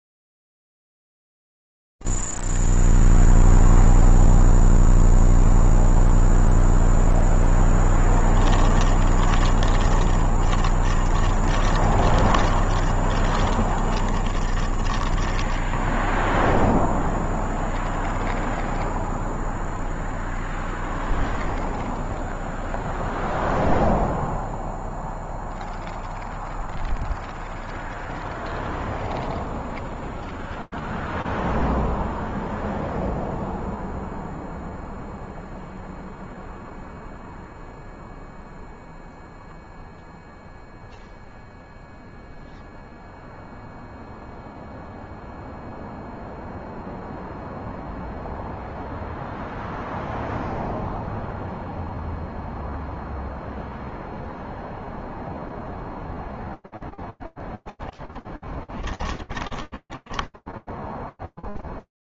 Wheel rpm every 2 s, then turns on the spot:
0, 0, 0, 0, 10, 30, 30, 30, 10, 0, 0, 0, 0, 0, 0, 0, 0, 0, 0, 0, 0, 0, 0, 0, 0, 0, 0, 0, 0, 20, 0.
8-18 58-60